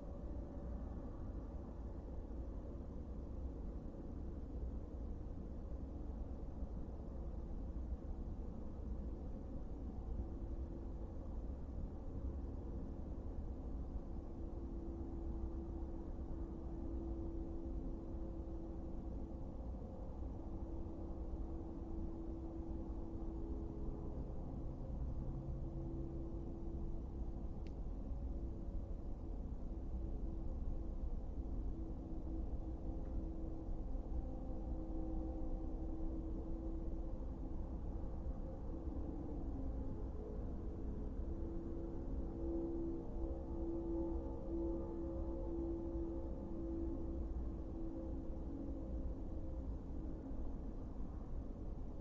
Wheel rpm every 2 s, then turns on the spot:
0, 0, 0, 0, 0, 0, 0, 0, 0, 0, 0, 0, 0, 0, 0, 0, 0, 0, 0, 0, 0, 0, 0, 0, 0, 0.
none